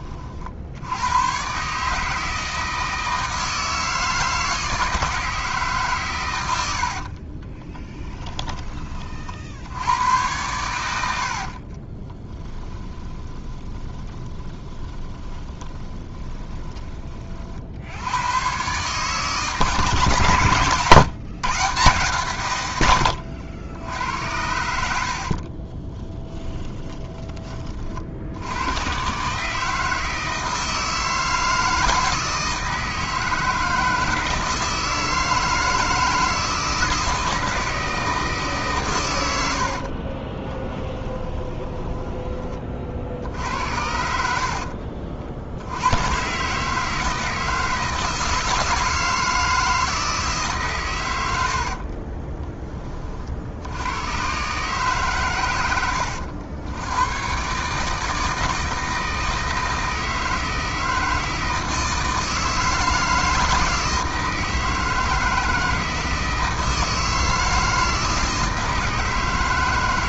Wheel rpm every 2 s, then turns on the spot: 100, 160, 160, 70, 30, 90, 20, 20, 20, 140, 140, 110, 60, 20, 110, 160, 160, 160, 160, 130, 10, 50, 50, 160, 160, 120, 30, 140, 100, 160, 160, 160, 160, 160, 160.
6-8 10-16 24-28 40-42